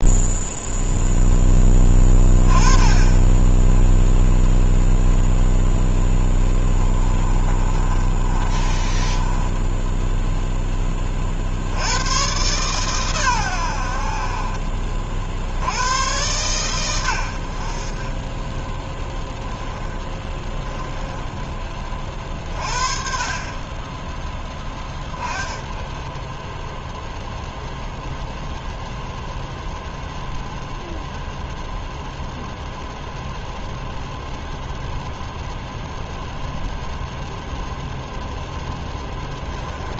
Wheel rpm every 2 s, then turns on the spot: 0, 20, 0, 10, 30, 10, 130, 40, 120, 10, 20, 40, 20, 10, 0, 0, 0, 0, 0, 0.
6-10 20-22